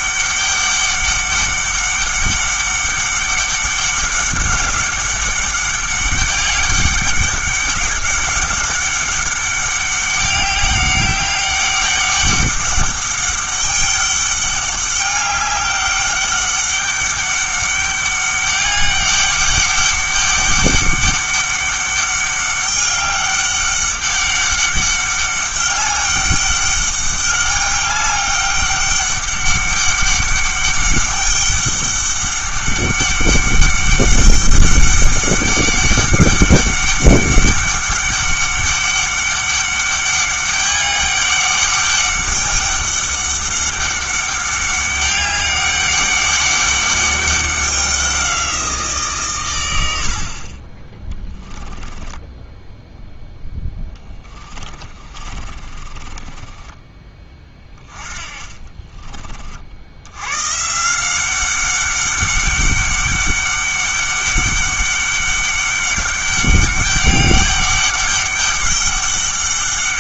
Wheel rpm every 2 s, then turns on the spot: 200, 200, 200, 200, 200, 200, 200, 200, 200, 200, 200, 200, 200, 200, 200, 200, 200, 200, 200, 200, 200, 200, 200, 200, 170, 30, 10, 30, 20, 30, 150, 200, 200, 200, 200.
52-60